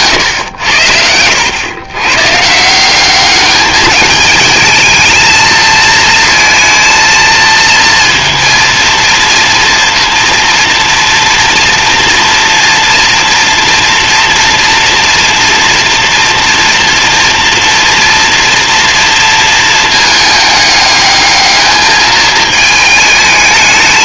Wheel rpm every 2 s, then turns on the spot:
90, 170, 220, 230, 230, 230, 230, 230, 230, 230, 210, 220.
none